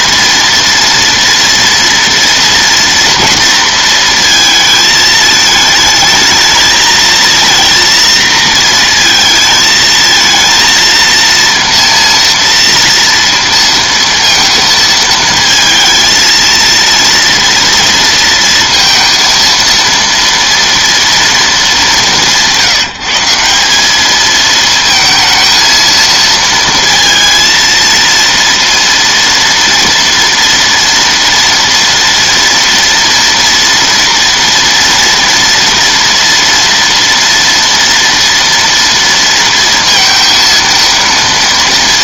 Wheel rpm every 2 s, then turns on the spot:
230, 230, 220, 220, 230, 230, 230, 220, 230, 230, 230, 160, 220, 230, 230, 230, 230, 230, 230, 230, 230.
none